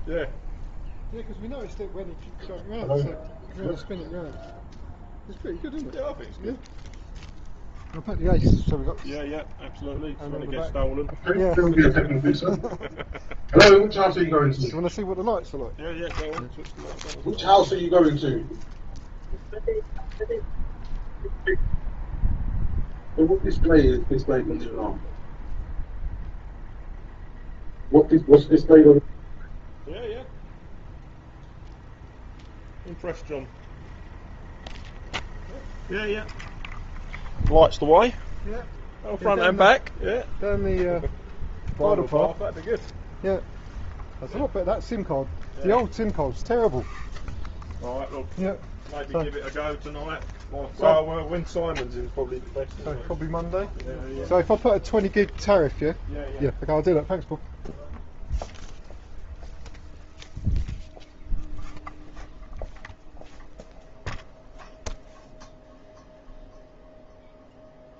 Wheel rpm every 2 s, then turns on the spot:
0, 0, 0, 0, 0, 0, 0, 0, 0, 0, 0, 0, 0, 0, 0, 0, 0, 0, 0, 0, 0, 0, 0, 0, 0, 0, 0, 0, 0, 0, 0, 0, 0, 0.
none